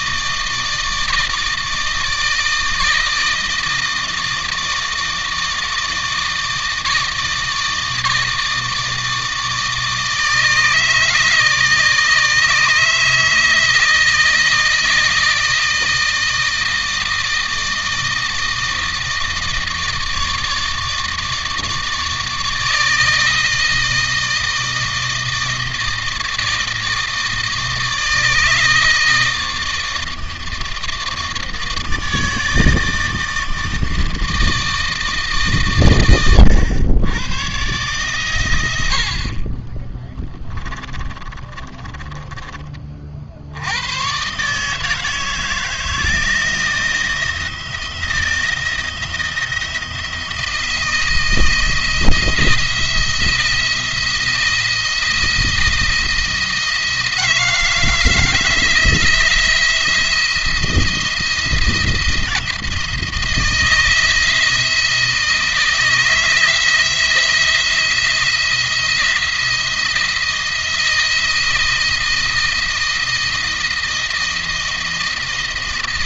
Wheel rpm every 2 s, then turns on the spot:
160, 160, 160, 160, 160, 160, 160, 160, 160, 160, 150, 160, 160, 160, 160, 160, 160, 160, 100, 90, 20, 40, 150, 170, 170, 170, 170, 170, 170, 170, 170, 160, 160, 160, 170, 170, 160, 170.
40-42